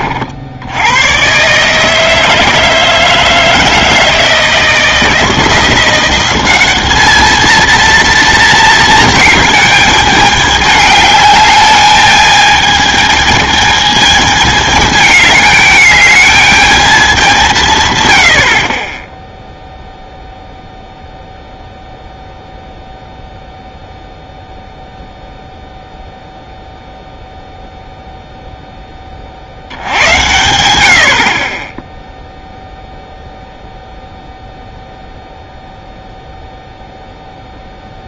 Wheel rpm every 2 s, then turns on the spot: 70, 160, 160, 200, 230, 210, 220, 220, 210, 50, 0, 0, 0, 0, 0, 80, 0, 0, 0.
none